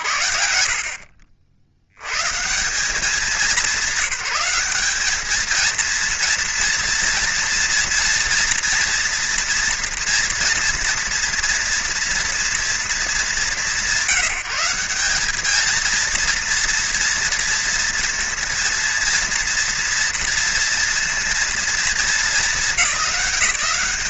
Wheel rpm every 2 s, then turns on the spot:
70, 200, 230, 230, 230, 230, 190, 230, 230, 230, 220, 200.
none